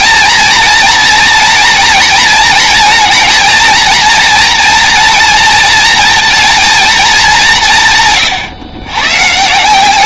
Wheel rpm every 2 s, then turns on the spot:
230, 230, 240, 230, 140.
none